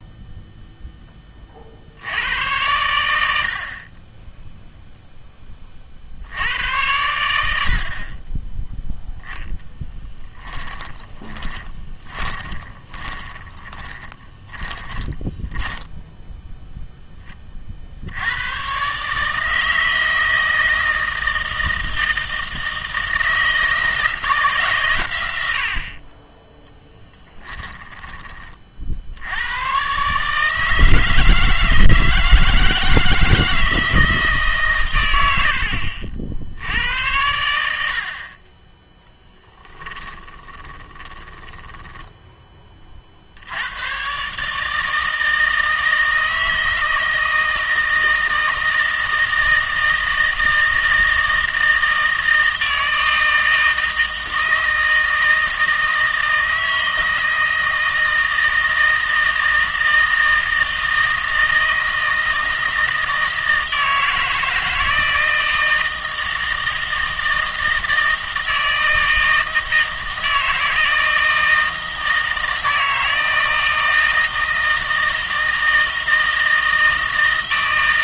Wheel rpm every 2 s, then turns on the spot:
0, 100, 0, 80, 10, 10, 20, 10, 0, 120, 160, 160, 150, 10, 40, 160, 160, 140, 70, 20, 20, 20, 150, 160, 160, 160, 160, 160, 160, 160, 160, 160, 160, 160, 160, 160, 160, 160, 160.
10-16 40-42